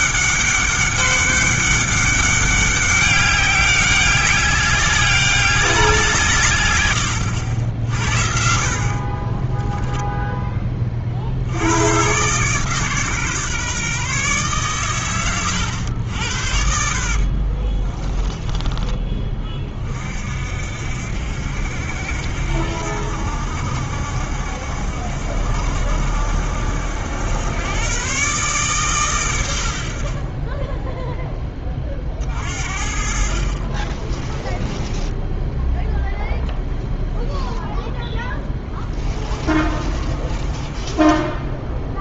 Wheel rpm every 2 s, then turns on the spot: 200, 200, 200, 100, 40, 30, 140, 120, 60, 20, 60, 70, 70, 80, 130, 10, 50, 10, 0, 20, 20.
16-18 34-36 38-42